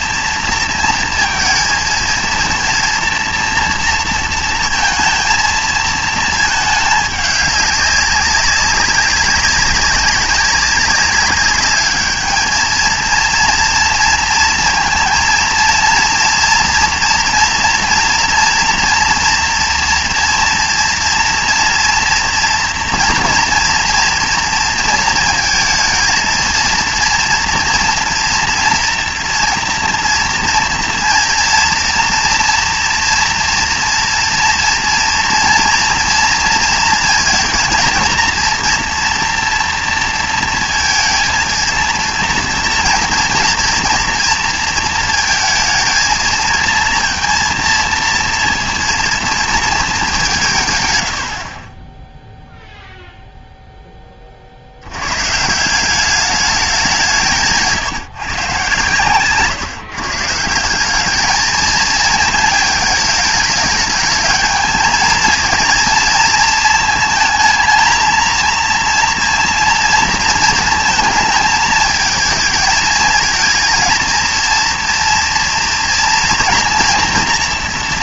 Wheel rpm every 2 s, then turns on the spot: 230, 230, 230, 210, 190, 200, 220, 230, 230, 230, 240, 230, 230, 230, 230, 230, 230, 230, 230, 230, 230, 230, 230, 220, 230, 140, 0, 60, 200, 130, 170, 220, 220, 220, 230, 230, 220, 230, 240.
none